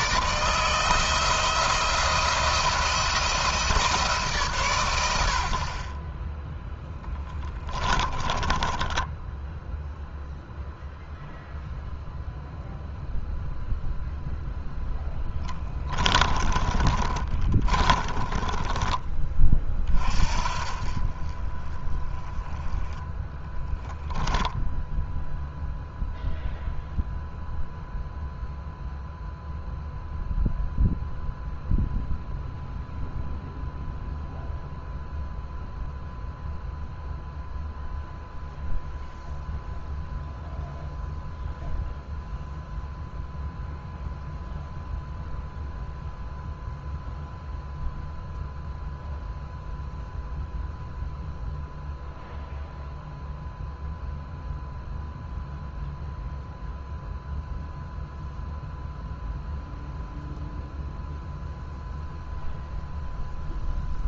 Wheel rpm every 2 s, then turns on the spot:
160, 170, 120, 10, 10, 0, 0, 10, 30, 20, 40, 20, 0, 0, 0, 0, 0, 0, 0, 0, 0, 0, 0, 0, 0, 0, 0, 0, 0, 0, 0, 0.
6-10 16-18